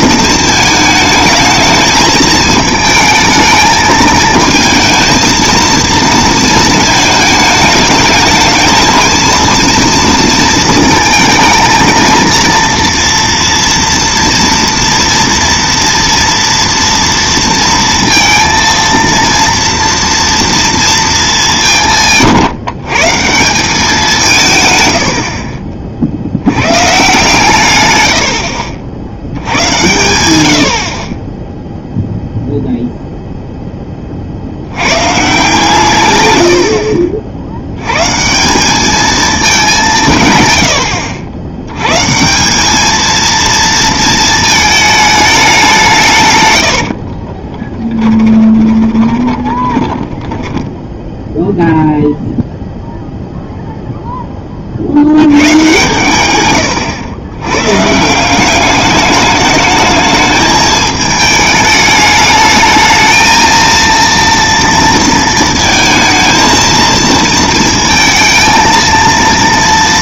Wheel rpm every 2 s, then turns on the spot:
220, 220, 220, 220, 210, 230, 230, 230, 230, 230, 230, 140, 150, 110, 80, 90, 0, 90, 80, 200, 100, 200, 220, 90, 20, 10, 0, 30, 120, 200, 220, 210, 230, 220, 230.
36-38 48-50